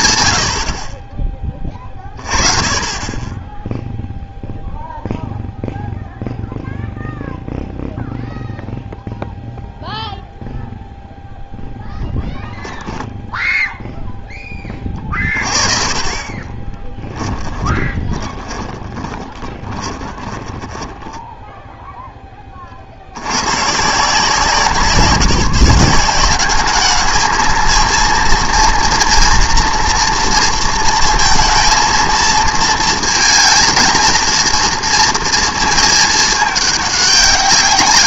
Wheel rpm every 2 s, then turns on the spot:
20, 0, 0, 0, 0, 10, 0, 30, 10, 10, 0, 130, 170, 220, 230, 230, 220, 230, 190.
16-20